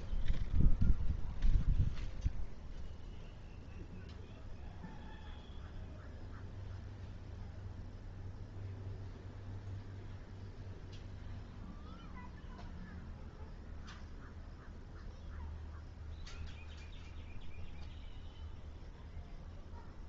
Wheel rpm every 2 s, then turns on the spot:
0, 0, 0, 0, 0, 0, 0, 0, 0, 0.
none